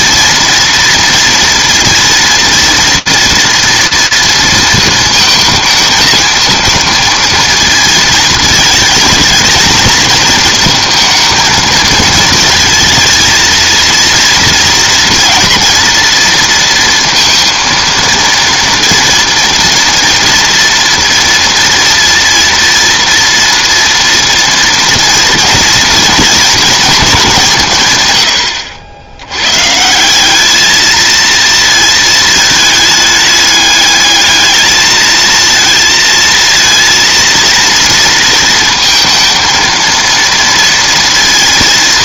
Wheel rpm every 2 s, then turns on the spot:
230, 230, 230, 220, 220, 230, 220, 230, 230, 230, 230, 230, 230, 230, 80, 220, 210, 220, 230, 230, 230.
none